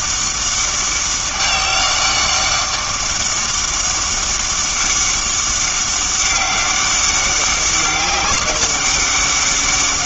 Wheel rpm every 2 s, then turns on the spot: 200, 200, 200, 200, 200.
none